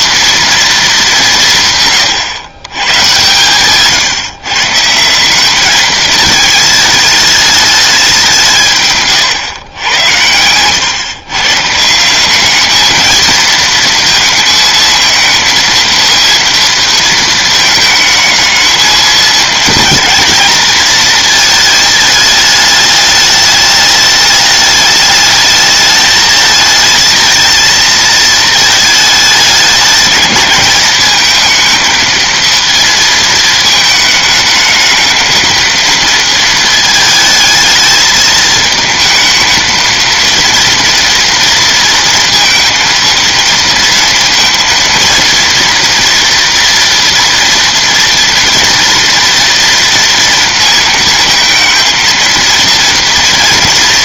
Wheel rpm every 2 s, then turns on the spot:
230, 120, 140, 220, 170, 120, 210, 230, 230, 220, 230, 210, 210, 220, 220, 210, 230, 220, 230, 220, 230, 230, 230, 230, 230, 230, 230.
10-12